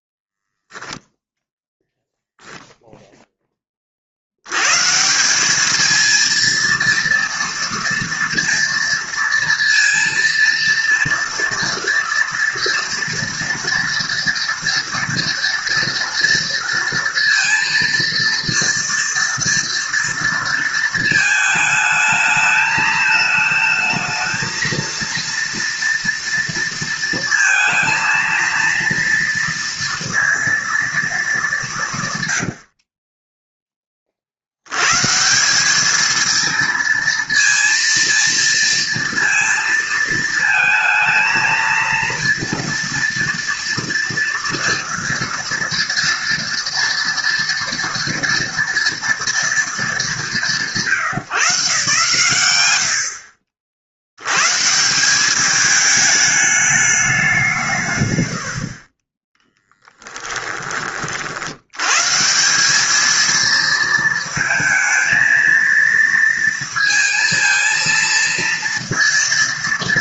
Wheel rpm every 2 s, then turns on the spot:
0, 0, 160, 230, 230, 240, 230, 230, 230, 230, 220, 220, 230, 230, 230, 220, 30, 100, 230, 230, 220, 230, 230, 230, 230, 140, 100, 120, 210, 90, 10, 160, 220, 230, 230.
32-34 60-62